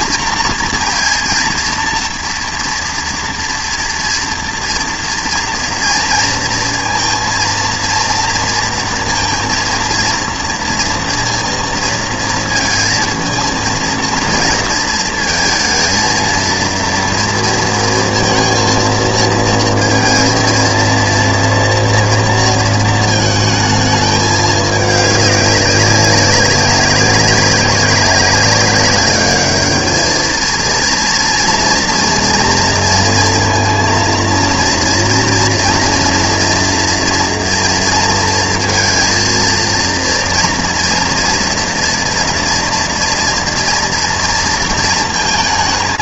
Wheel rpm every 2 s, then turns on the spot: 230, 230, 230, 230, 230, 230, 230, 230, 220, 230, 230, 230, 210, 200, 200, 230, 230, 230, 230, 230, 230, 230, 230.
none